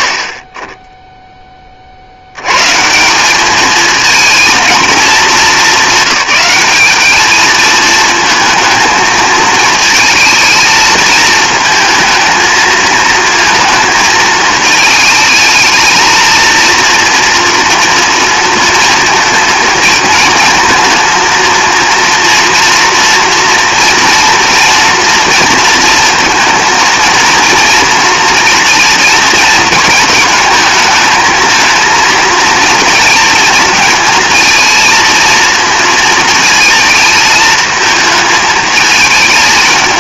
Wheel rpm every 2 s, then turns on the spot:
30, 140, 230, 210, 220, 220, 220, 220, 230, 220, 230, 230, 230, 220, 230, 220, 230, 230, 220, 220.
none